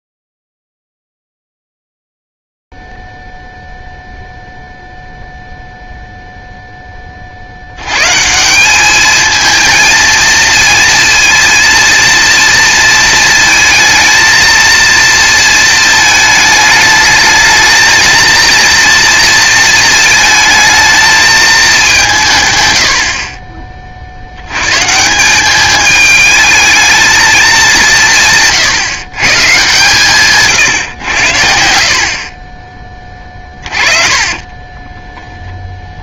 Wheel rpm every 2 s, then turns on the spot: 0, 0, 0, 0, 160, 230, 230, 230, 220, 230, 220, 140, 90, 220, 160, 140, 30, 20.
34-36